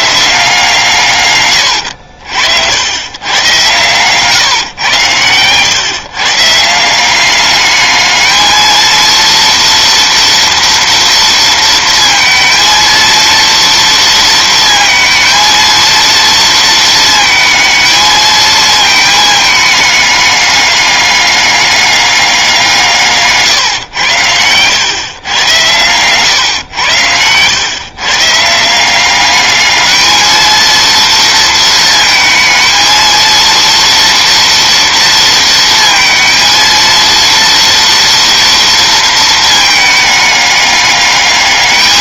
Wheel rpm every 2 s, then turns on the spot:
170, 70, 120, 160, 220, 230, 230, 230, 230, 220, 200, 180, 110, 110, 170, 230, 220, 230, 230, 230, 210.
none